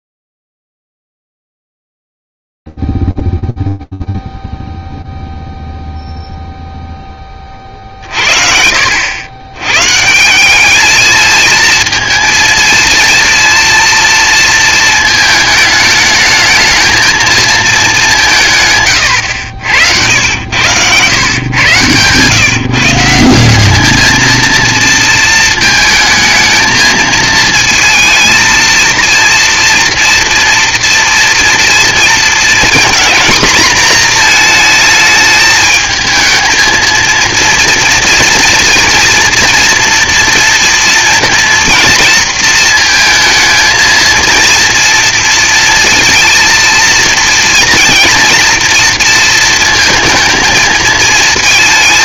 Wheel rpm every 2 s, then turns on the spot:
0, 0, 0, 0, 50, 180, 230, 230, 220, 170, 90, 140, 230, 220, 230, 230, 230, 230, 220, 240, 230, 230, 230, 230, 230, 220.
none